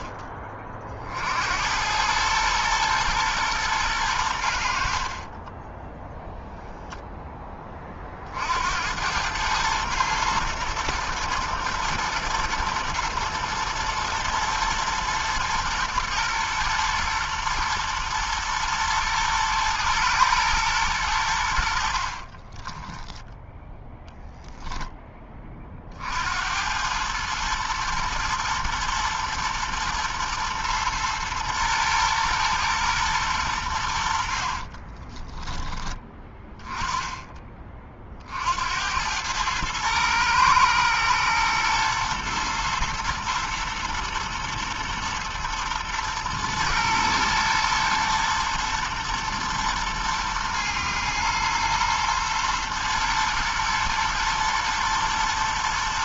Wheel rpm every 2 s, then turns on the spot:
40, 100, 100, 0, 40, 110, 120, 110, 120, 110, 120, 50, 0, 70, 110, 120, 120, 70, 10, 50, 110, 120, 110, 120, 110, 110, 120, 120.
22-24